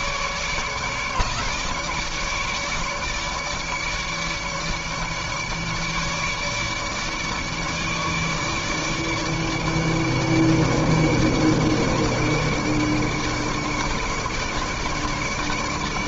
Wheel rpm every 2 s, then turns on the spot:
150, 150, 150, 150, 150, 150, 150, 150.
none